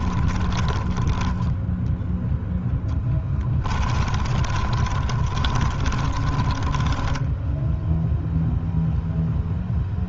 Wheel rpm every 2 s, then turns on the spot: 20, 10, 30, 20, 0.
2-6